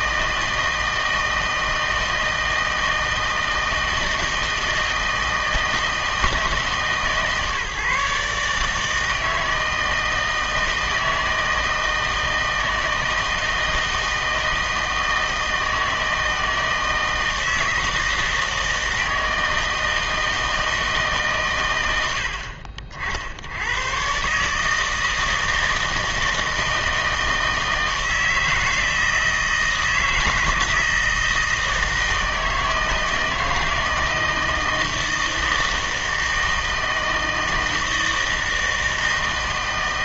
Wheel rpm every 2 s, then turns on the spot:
160, 160, 160, 150, 150, 160, 160, 160, 160, 160, 160, 50, 150, 160, 160, 160, 160, 160, 160, 160.
none